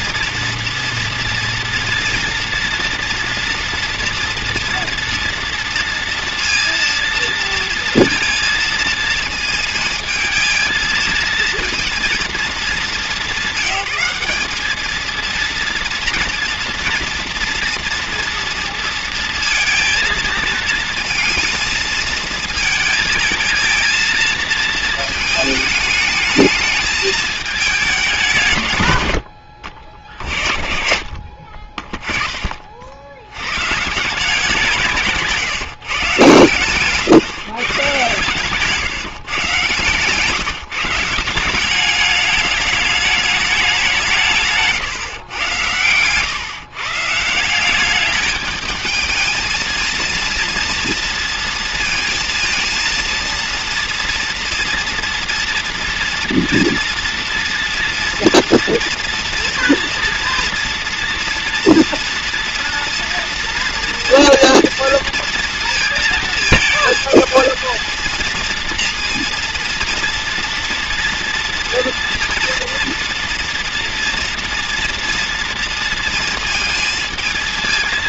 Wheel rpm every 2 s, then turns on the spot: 230, 230, 230, 230, 230, 220, 200, 210, 230, 230, 230, 220, 230, 220, 120, 50, 50, 170, 120, 140, 160, 210, 140, 140, 220, 230, 230, 230, 230, 230, 240, 240, 240, 220, 230, 230, 240, 240, 230.
none